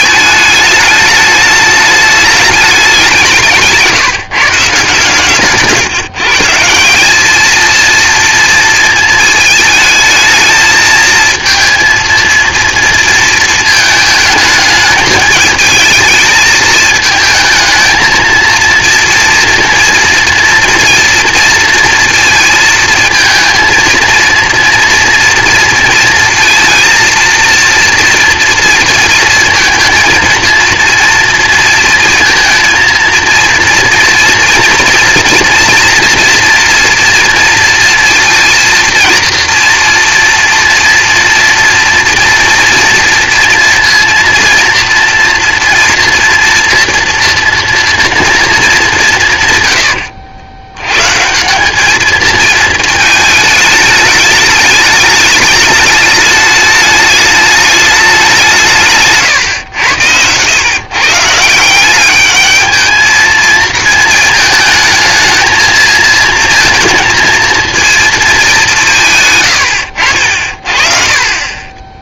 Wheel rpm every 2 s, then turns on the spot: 220, 200, 140, 160, 230, 220, 230, 220, 220, 230, 230, 230, 230, 230, 230, 230, 230, 240, 230, 230, 230, 240, 240, 230, 220, 100, 220, 210, 210, 160, 130, 220, 220, 220, 190, 50.
none